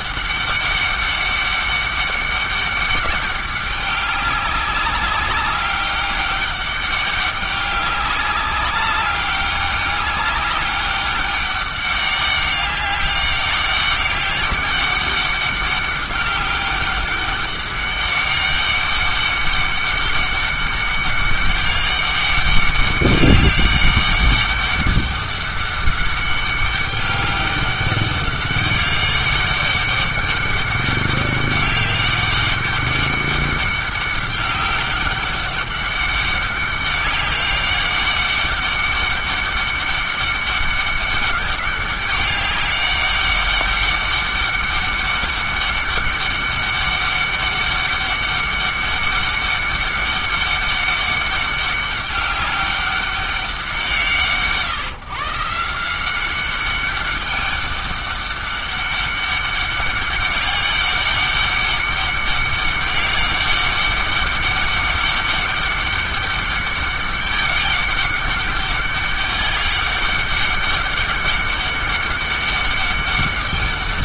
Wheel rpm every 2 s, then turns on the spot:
200, 200, 200, 200, 200, 200, 200, 200, 200, 200, 200, 200, 200, 200, 200, 200, 200, 200, 200, 200, 200, 200, 200, 200, 200, 200, 200, 150, 200, 200, 200, 200, 200, 200, 200, 200, 200.
none